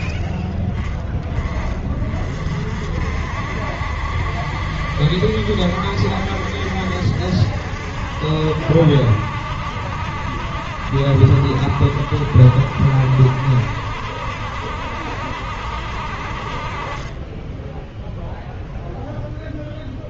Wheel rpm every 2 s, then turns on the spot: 10, 50, 70, 70, 70, 70, 60, 70, 50, 0.
none